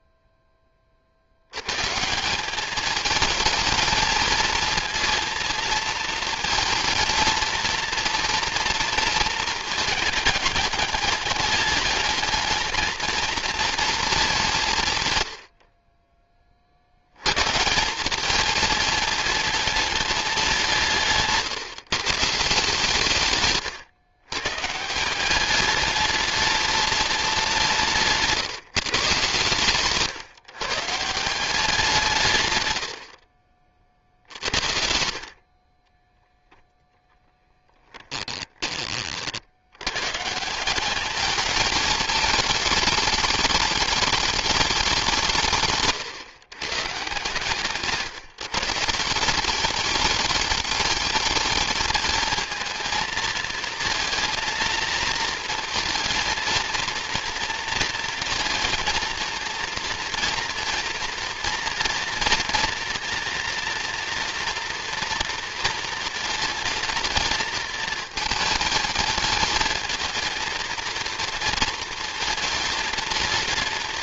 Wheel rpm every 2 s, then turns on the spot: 30, 210, 230, 230, 230, 210, 220, 160, 60, 220, 160, 150, 160, 210, 150, 150, 90, 60, 0, 30, 190, 210, 200, 130, 160, 210, 230, 220, 230, 230, 230, 240, 230, 230, 220, 230, 230.
none